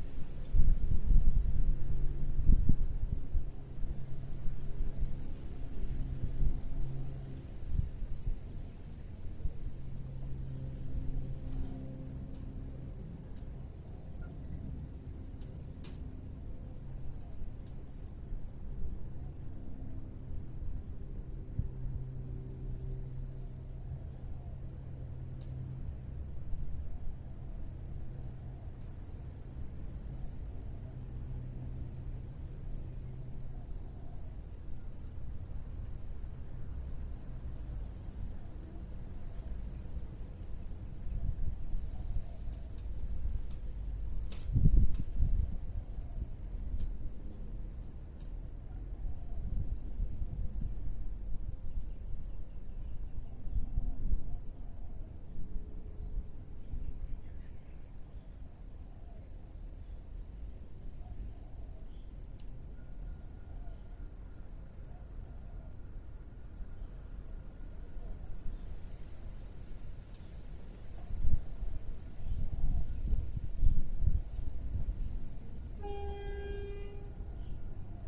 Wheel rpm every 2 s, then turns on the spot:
0, 0, 0, 0, 0, 0, 0, 0, 0, 0, 0, 0, 0, 0, 0, 0, 0, 0, 0, 0, 0, 0, 0, 0, 0, 0, 0, 0, 0, 0, 0, 0, 0, 0, 0, 0, 0, 0, 0.
none